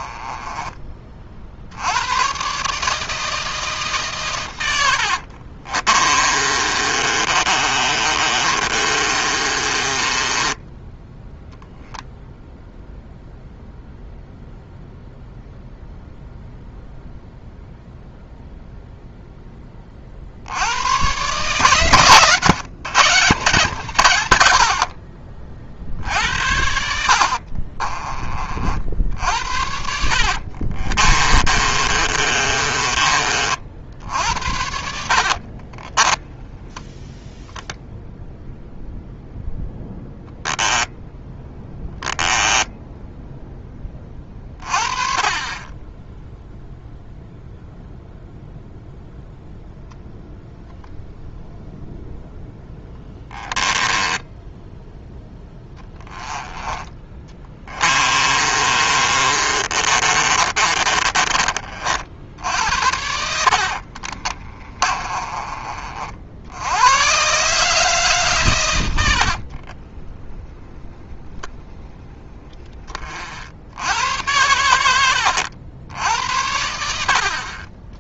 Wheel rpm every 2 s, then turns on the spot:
30, 150, 80, 30, 30, 10, 0, 0, 0, 0, 100, 160, 60, 70, 60, 40, 30, 60, 10, 0, 0, 10, 30, 0, 0, 0, 10, 10, 20, 30, 30, 70, 30, 110, 80, 20, 30, 90, 80.
4-10 30-34 52-54 58-66 68-70